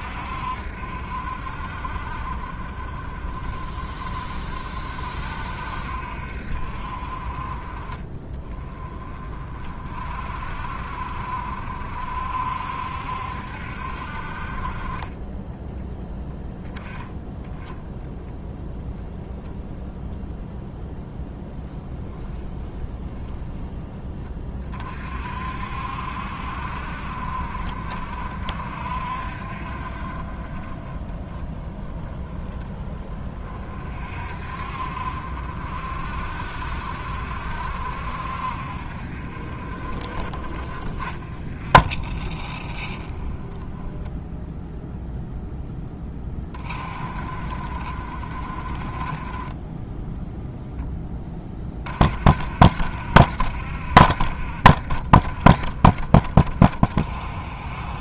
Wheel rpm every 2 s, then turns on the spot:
60, 40, 50, 40, 30, 50, 60, 30, 10, 0, 0, 20, 40, 50, 50, 20, 20, 50, 60, 50, 30, 10, 0, 30, 30, 10, 70, 50, 30.
none